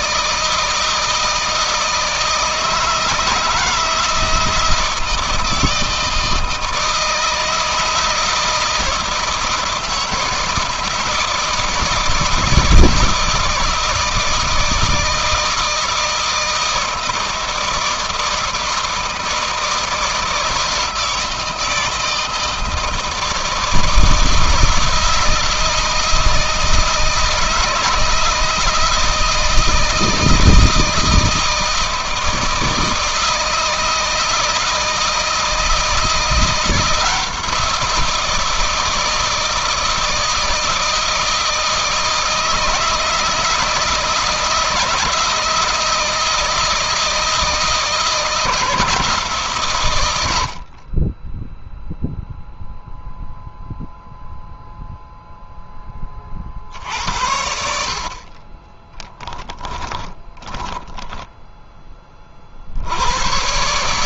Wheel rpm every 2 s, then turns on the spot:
160, 160, 160, 160, 160, 170, 160, 160, 160, 160, 160, 160, 160, 160, 160, 160, 160, 160, 170, 160, 160, 160, 160, 160, 170, 40, 0, 0, 70, 20, 10, 80.
58-62